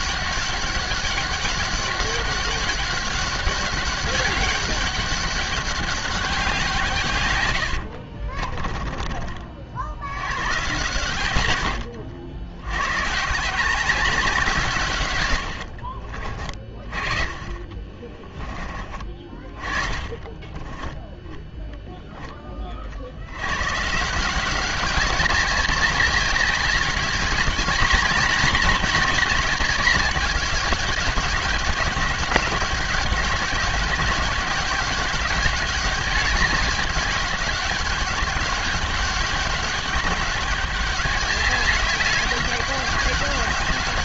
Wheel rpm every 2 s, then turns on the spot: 200, 200, 200, 170, 30, 130, 100, 160, 40, 20, 10, 50, 190, 200, 220, 200, 200, 190, 200, 200, 200, 200.
8-10